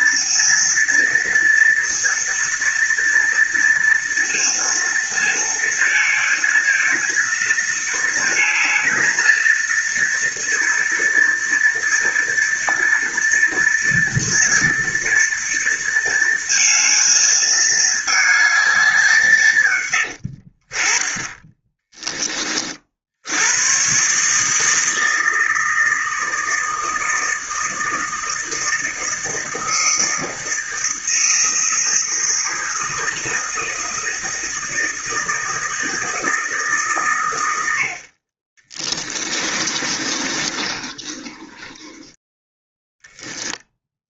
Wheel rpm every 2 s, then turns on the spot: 230, 230, 230, 220, 220, 230, 230, 230, 230, 220, 80, 20, 150, 160, 160, 160, 160, 160, 160, 40, 30, 10.
20-22 40-44